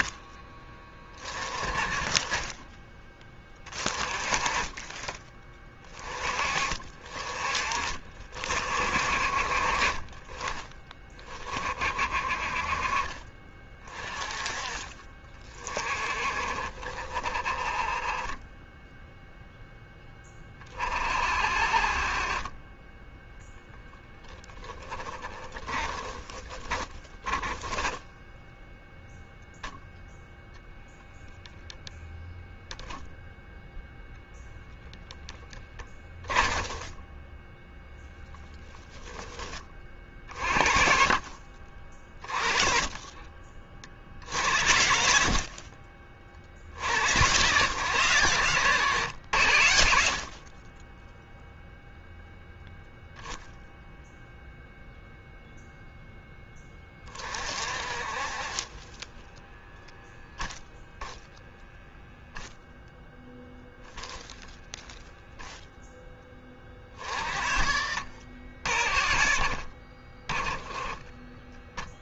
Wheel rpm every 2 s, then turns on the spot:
10, 10, 20, 30, 40, 20, 20, 30, 30, 0, 20, 10, 10, 20, 0, 0, 0, 0, 10, 10, 40, 20, 60, 60, 110, 30, 0, 0, 20, 20, 0, 0, 0, 40, 50, 20.
24-28 36-38